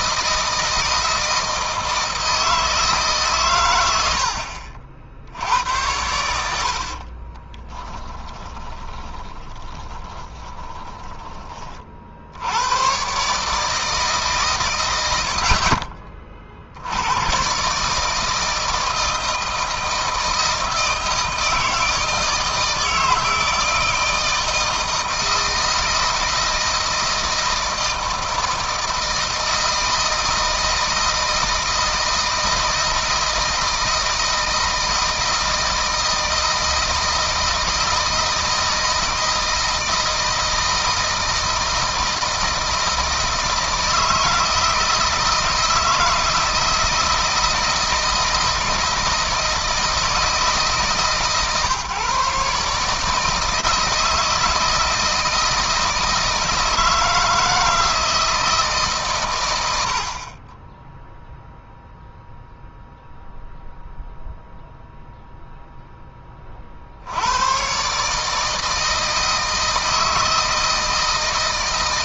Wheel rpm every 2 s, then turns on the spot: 160, 150, 60, 40, 30, 20, 120, 130, 80, 160, 160, 160, 160, 160, 160, 160, 160, 160, 160, 160, 170, 160, 160, 160, 160, 150, 150, 160, 160, 140, 10, 0, 0, 70, 160, 160.
6-12